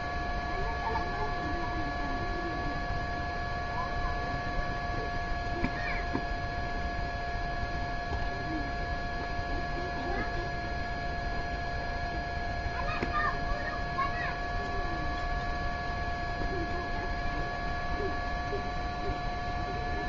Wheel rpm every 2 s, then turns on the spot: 0, 0, 0, 0, 0, 0, 0, 0, 0, 0.
none